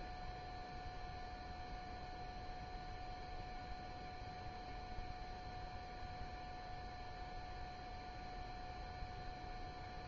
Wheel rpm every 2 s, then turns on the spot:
0, 0, 0, 0, 0.
none